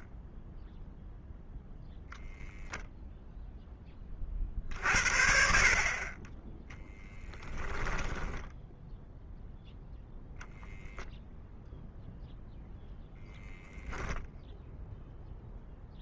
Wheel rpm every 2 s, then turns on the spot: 10, 0, 50, 30, 0, 0, 0, 0.
6-8